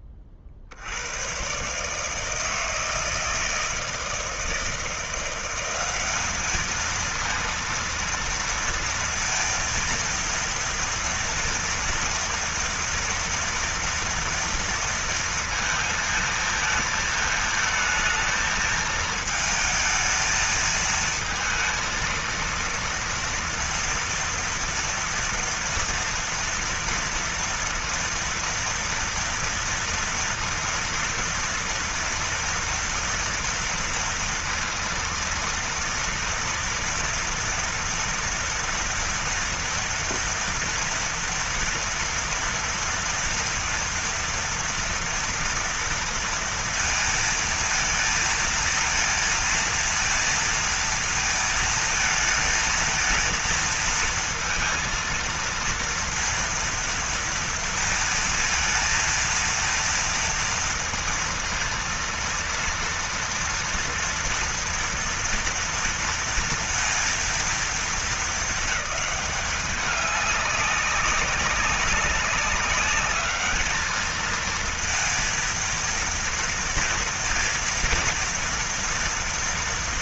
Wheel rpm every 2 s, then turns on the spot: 50, 160, 160, 210, 230, 230, 230, 230, 220, 220, 220, 230, 230, 240, 230, 230, 230, 230, 230, 230, 230, 230, 240, 230, 220, 230, 230, 230, 230, 230, 230, 230, 230, 230, 220, 200, 200, 230, 230, 230.
none